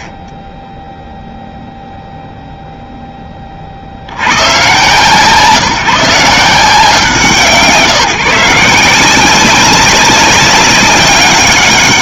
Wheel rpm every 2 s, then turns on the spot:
30, 0, 110, 160, 170, 200.
none